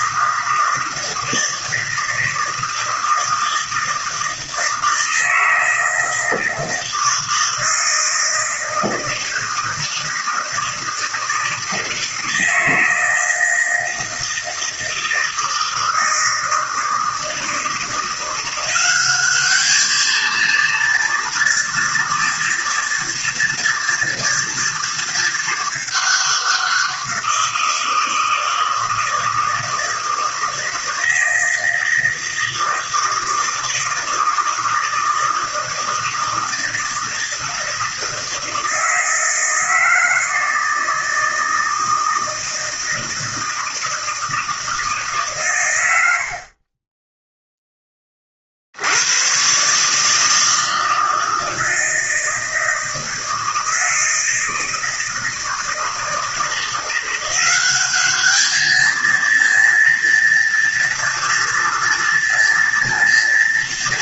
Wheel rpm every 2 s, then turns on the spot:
160, 160, 160, 160, 160, 160, 160, 160, 170, 230, 230, 230, 200, 160, 160, 160, 160, 160, 160, 160, 160, 160, 90, 10, 140, 160, 160, 160, 190, 230, 230, 240.
none